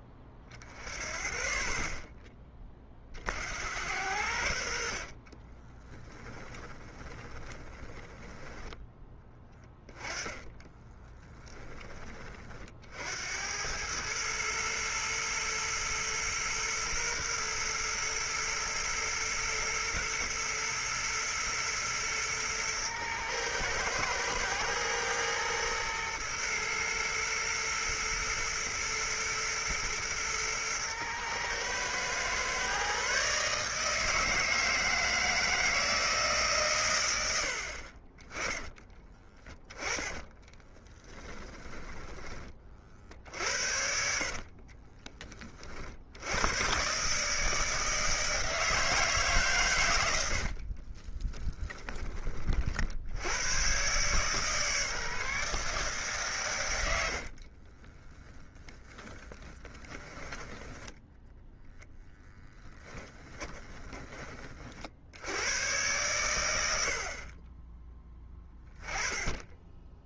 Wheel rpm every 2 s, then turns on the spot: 20, 20, 80, 20, 10, 10, 40, 110, 120, 120, 120, 110, 110, 120, 110, 110, 130, 160, 140, 20, 10, 30, 40, 110, 160, 60, 50, 150, 120, 20, 10, 10, 40, 90, 10.
6-8 10-12 40-42 44-46 50-52 58-60